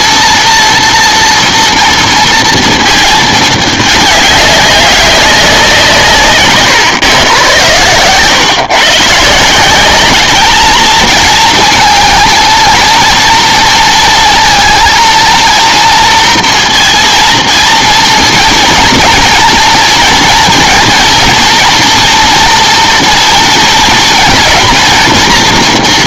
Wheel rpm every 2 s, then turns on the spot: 230, 230, 200, 130, 130, 220, 230, 230, 230, 230, 240, 230, 230.
none